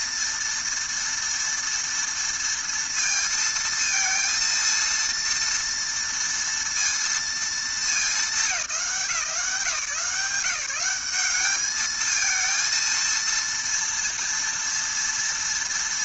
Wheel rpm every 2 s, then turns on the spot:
230, 230, 230, 230, 190, 170, 220, 230.
none